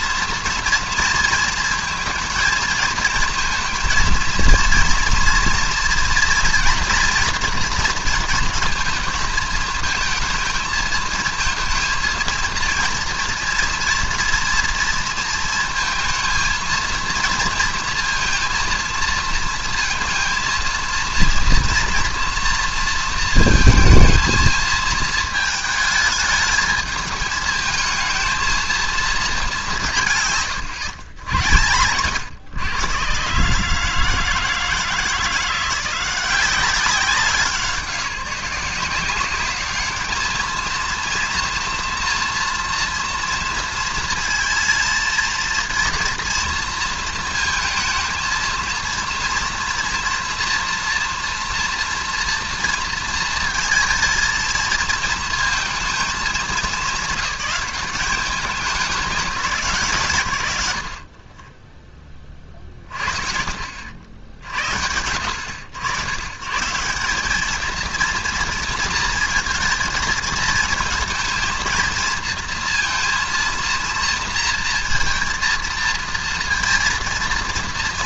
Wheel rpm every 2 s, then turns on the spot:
230, 230, 230, 230, 220, 230, 230, 230, 230, 230, 230, 230, 230, 210, 220, 120, 110, 160, 190, 180, 230, 240, 230, 230, 230, 230, 230, 230, 190, 190, 70, 30, 70, 160, 230, 230, 230, 230, 230.
none